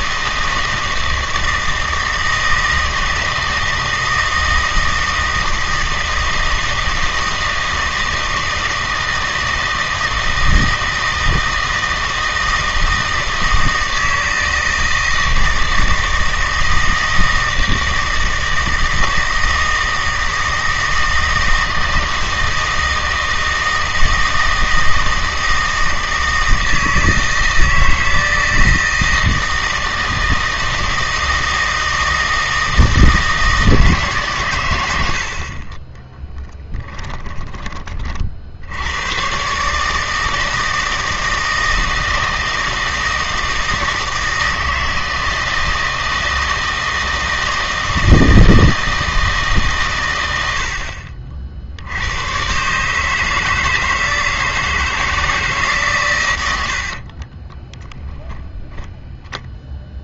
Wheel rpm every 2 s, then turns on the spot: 160, 160, 160, 160, 160, 160, 160, 160, 160, 160, 160, 160, 160, 160, 160, 160, 160, 110, 10, 80, 160, 160, 160, 160, 160, 70, 140, 160, 90, 10.
36-38 56-58